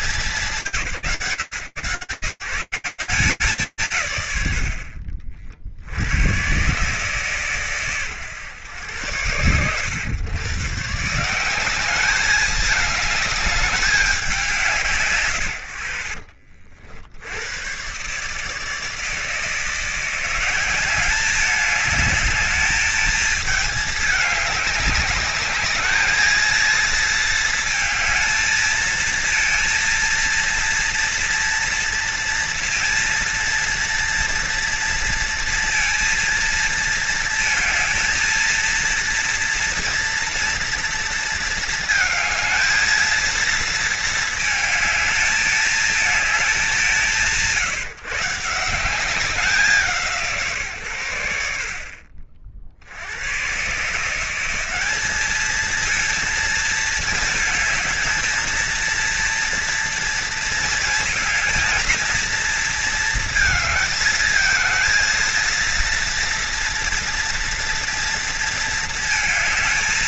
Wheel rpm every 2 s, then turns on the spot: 160, 160, 90, 120, 110, 130, 210, 150, 50, 150, 190, 210, 200, 220, 230, 230, 230, 230, 230, 230, 230, 220, 220, 170, 190, 120, 70, 200, 220, 230, 230, 220, 220, 230, 220.
none